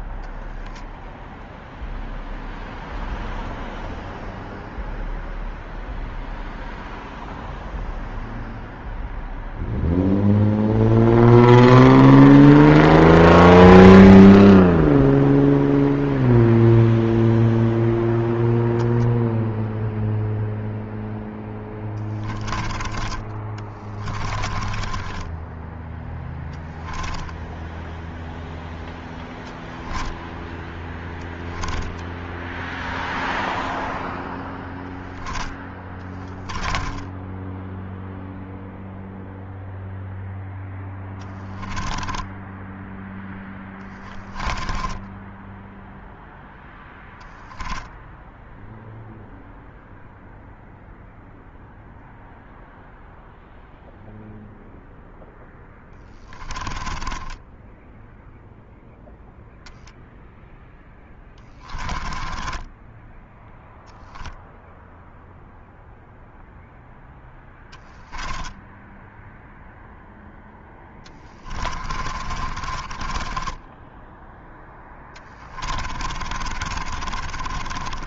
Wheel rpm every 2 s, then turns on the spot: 0, 0, 0, 0, 0, 0, 0, 0, 0, 0, 0, 20, 10, 10, 10, 0, 0, 0, 10, 0, 10, 0, 10, 0, 0, 0, 0, 0, 20, 0, 10, 10, 0, 10, 0, 20, 20, 10, 40.
24-26 36-38 40-42 44-46 56-58 60-64 70-78